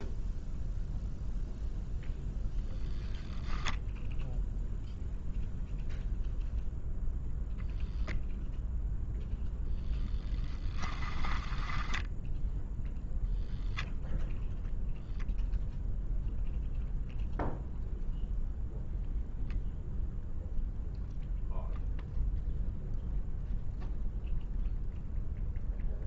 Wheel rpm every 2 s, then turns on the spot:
0, 0, 0, 0, 0, 10, 0, 0, 0, 0, 0, 0, 0.
10-12